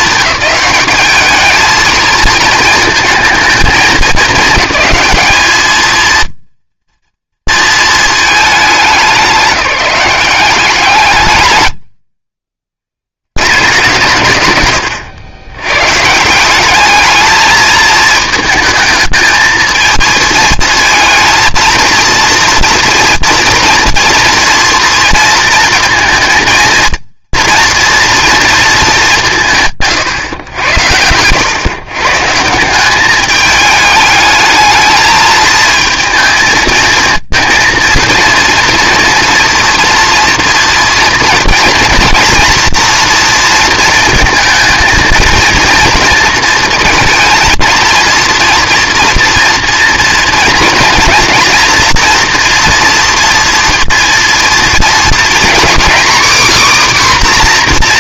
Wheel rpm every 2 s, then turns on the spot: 220, 220, 210, 230, 210, 190, 110, 110, 190, 220, 220, 230, 230, 230, 220, 100, 170, 220, 230, 230, 230, 230, 220, 230, 230, 230, 230, 230, 280.
none